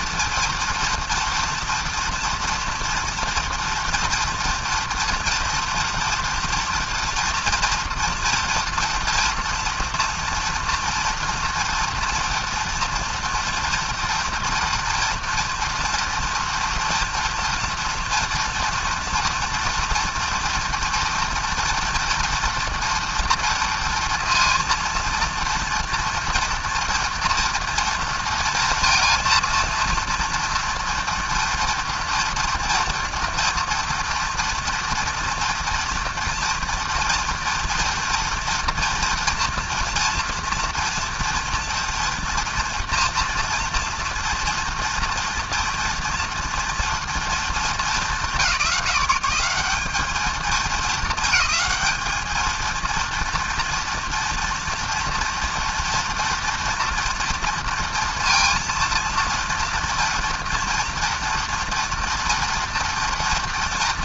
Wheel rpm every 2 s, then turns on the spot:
230, 230, 230, 230, 240, 230, 230, 230, 230, 230, 230, 230, 230, 230, 230, 230, 230, 240, 230, 230, 240, 230, 230, 230, 180, 220, 230, 230, 230, 230, 240, 230.
none